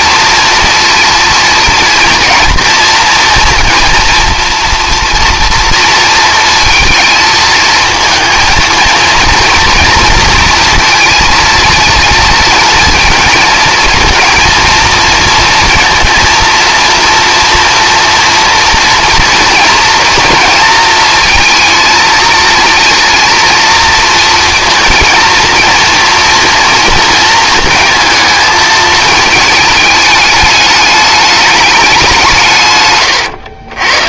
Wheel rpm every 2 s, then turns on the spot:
230, 230, 230, 230, 230, 230, 230, 230, 240, 240, 230, 230, 230, 230, 220, 210, 140.
none